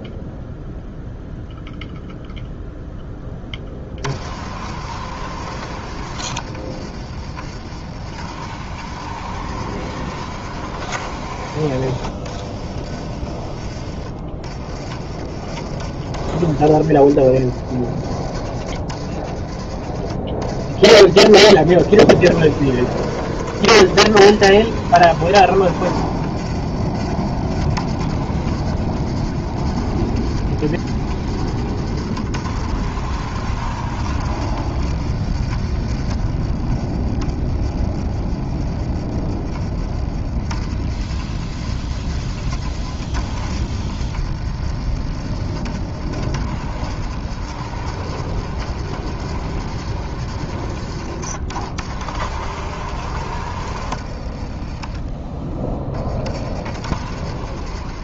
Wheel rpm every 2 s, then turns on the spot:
0, 0, 50, 50, 60, 60, 40, 30, 40, 40, 40, 60, 60, 60, 60, 60, 60, 60, 30, 30, 40, 50, 50, 60, 60, 50, 50, 20, 50.
54-56